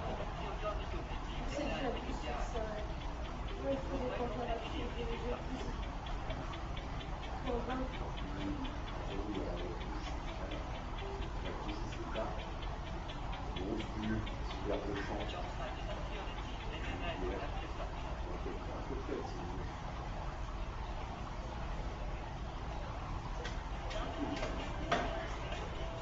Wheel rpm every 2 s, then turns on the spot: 0, 0, 0, 0, 0, 0, 0, 0, 0, 0, 0, 0, 0.
none